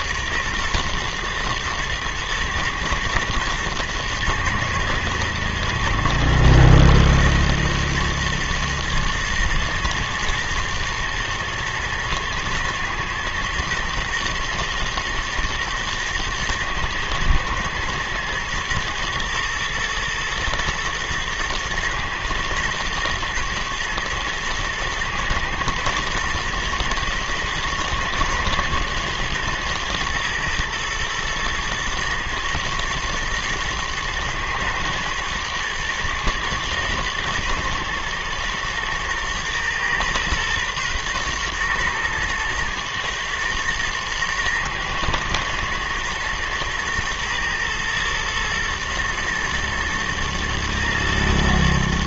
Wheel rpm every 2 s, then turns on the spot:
120, 110, 120, 120, 120, 120, 110, 120, 110, 110, 120, 110, 110, 120, 110, 120, 120, 110, 120, 120, 120, 120, 120, 120, 120, 110.
none